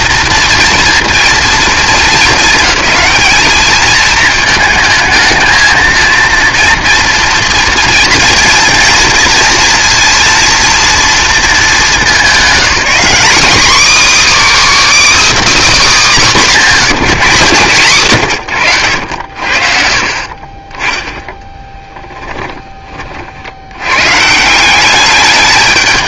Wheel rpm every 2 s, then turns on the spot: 230, 220, 220, 230, 230, 240, 220, 320, 200, 100, 20, 20, 180.
none